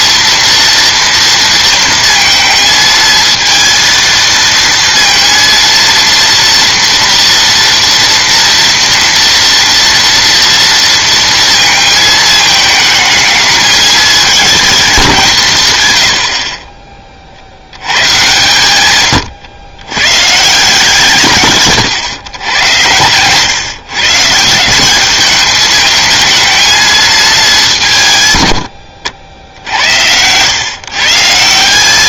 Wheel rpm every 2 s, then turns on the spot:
230, 220, 230, 240, 230, 230, 220, 210, 40, 130, 140, 110, 170, 220, 110, 110.
none